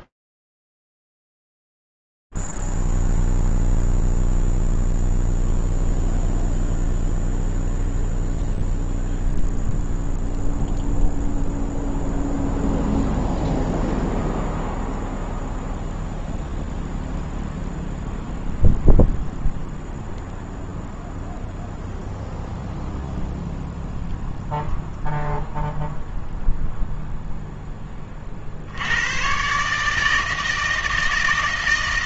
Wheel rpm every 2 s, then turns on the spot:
0, 0, 0, 0, 0, 0, 0, 0, 0, 0, 0, 0, 0, 0, 60, 160.
none